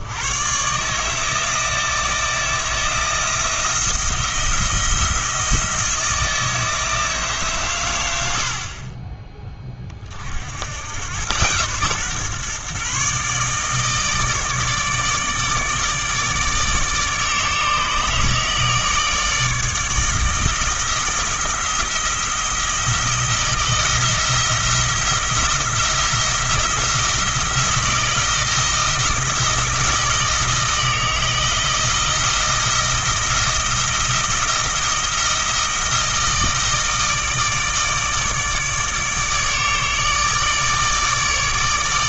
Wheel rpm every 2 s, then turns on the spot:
130, 170, 170, 160, 40, 80, 130, 150, 150, 150, 160, 170, 170, 170, 170, 160, 170, 160, 160, 150, 150.
none